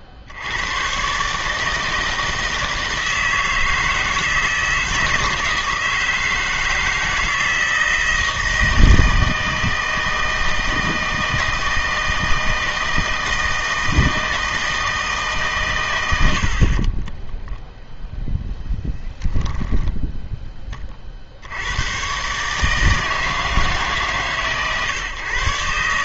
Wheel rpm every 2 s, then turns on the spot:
100, 160, 160, 160, 160, 160, 160, 160, 60, 10, 20, 150, 130.
18-20